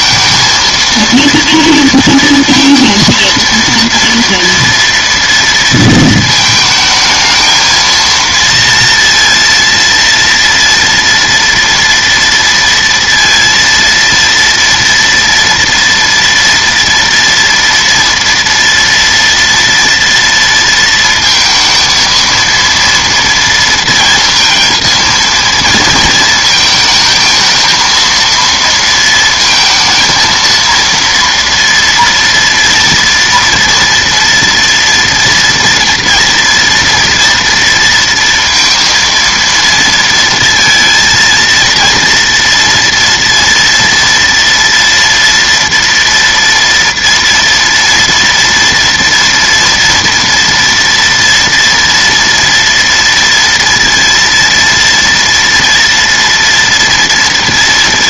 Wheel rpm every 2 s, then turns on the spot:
230, 230, 230, 220, 230, 230, 230, 230, 240, 230, 230, 230, 230, 220, 230, 230, 230, 240, 230, 230, 230, 230, 230, 230, 230, 230, 230, 230, 240.
none